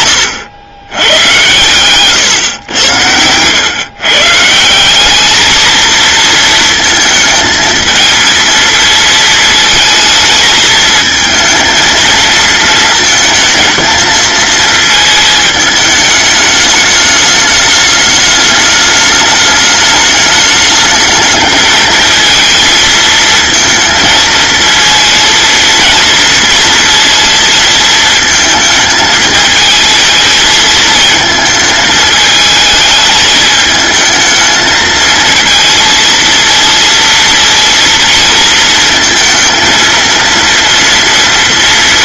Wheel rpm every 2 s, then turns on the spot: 100, 110, 180, 220, 230, 220, 220, 220, 210, 210, 210, 230, 230, 230, 220, 220, 220, 220, 230, 230, 240.
none